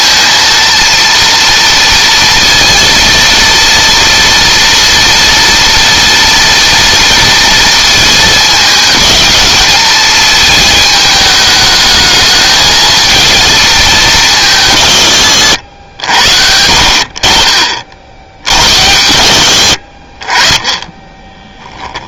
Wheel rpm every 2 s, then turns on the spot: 230, 230, 230, 230, 210, 220, 220, 130, 70, 80, 20.
none